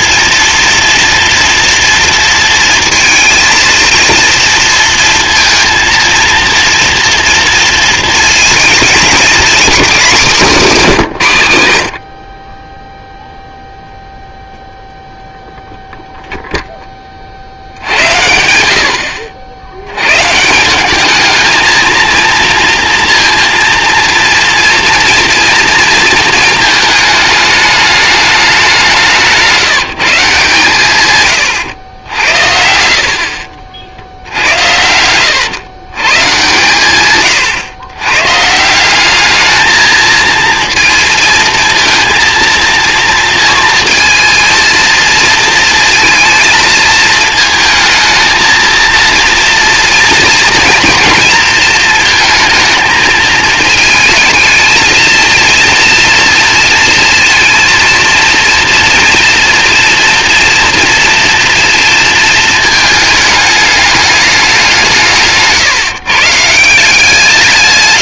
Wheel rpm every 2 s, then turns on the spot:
230, 230, 230, 230, 220, 180, 30, 0, 0, 90, 150, 230, 230, 220, 200, 150, 70, 70, 140, 140, 230, 230, 230, 220, 220, 240, 230, 220, 230, 230, 240, 220, 190, 160.
32-36